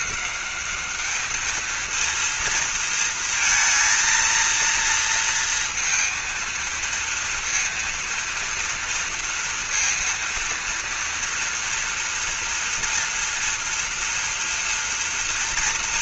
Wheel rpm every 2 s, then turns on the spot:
200, 230, 230, 230, 230, 230, 230, 230.
none